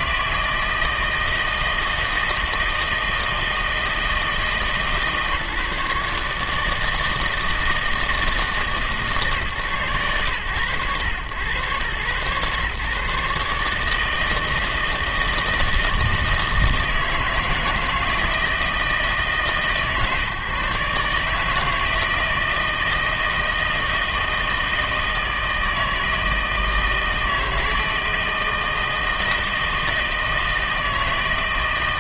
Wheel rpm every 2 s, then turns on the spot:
160, 160, 150, 160, 150, 100, 130, 160, 160, 160, 150, 170, 160, 160, 160, 160.
none